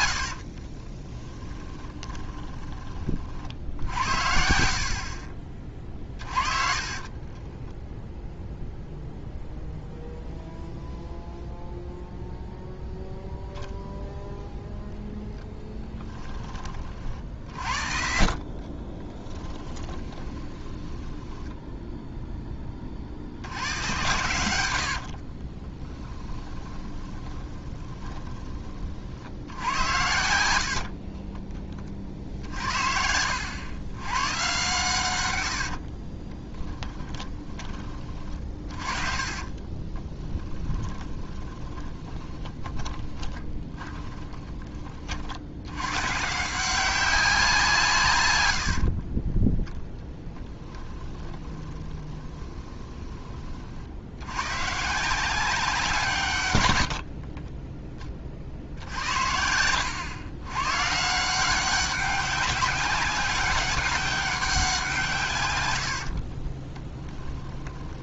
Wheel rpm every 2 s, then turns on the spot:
50, 20, 60, 40, 0, 0, 0, 0, 30, 30, 20, 20, 80, 20, 30, 60, 60, 110, 10, 30, 10, 20, 30, 180, 70, 10, 20, 140, 100, 70, 140, 200, 180, 30.
0-2 6-8 18-22 24-28 30-34 36-44 48-54 66-68